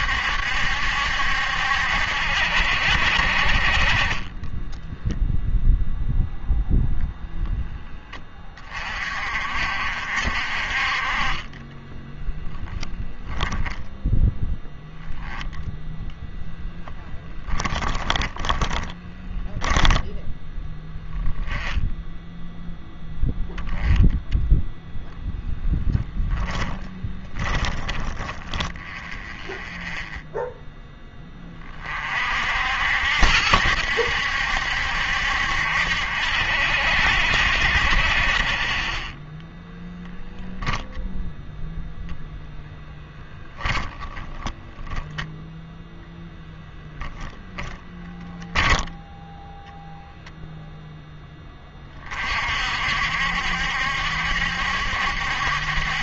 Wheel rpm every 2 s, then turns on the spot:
70, 70, 10, 0, 30, 40, 0, 10, 10, 10, 10, 10, 10, 10, 10, 0, 60, 70, 70, 30, 0, 10, 10, 0, 10, 0, 50, 70.
4-6 18-20 44-46